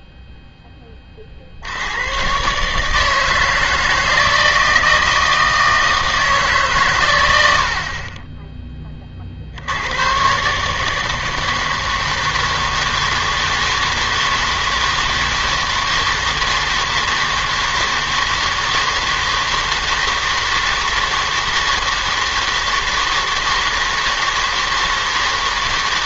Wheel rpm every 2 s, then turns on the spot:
20, 150, 160, 120, 20, 150, 160, 160, 160, 160, 160, 160, 160.
none